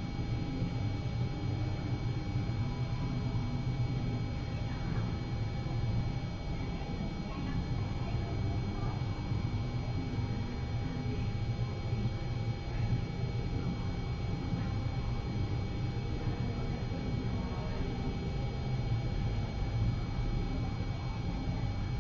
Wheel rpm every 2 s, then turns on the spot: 0, 0, 0, 0, 0, 0, 0, 0, 0, 0, 0.
none